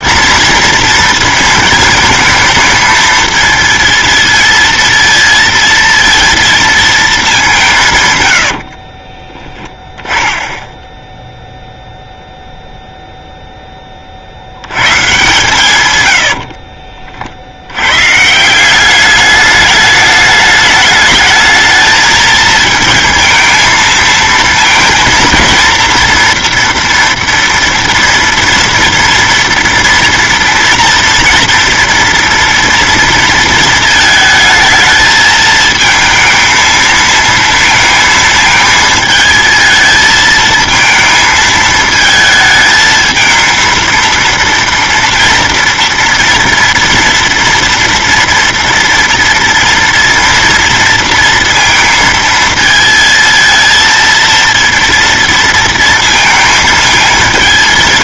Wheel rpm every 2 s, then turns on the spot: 230, 220, 230, 210, 30, 0, 0, 120, 50, 200, 220, 230, 230, 230, 230, 230, 230, 220, 220, 220, 220, 220, 230, 230, 230, 230, 230, 230, 220.
8-10